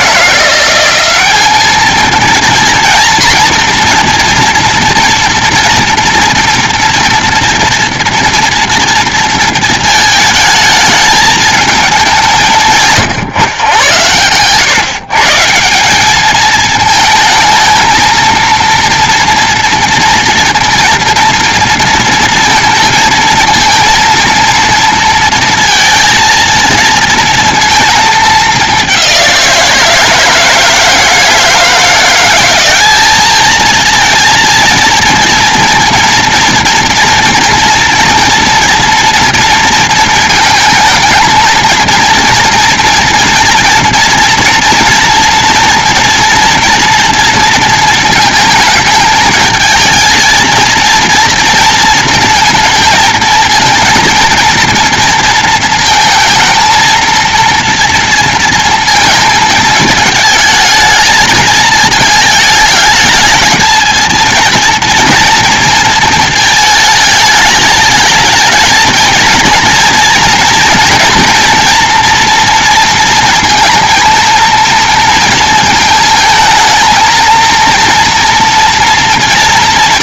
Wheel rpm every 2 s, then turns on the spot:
170, 230, 230, 230, 230, 210, 170, 120, 220, 230, 240, 230, 230, 230, 210, 160, 190, 230, 230, 230, 220, 230, 230, 230, 220, 220, 230, 230, 220, 230, 220, 220, 230, 220, 220, 230, 230, 230, 220, 230.
none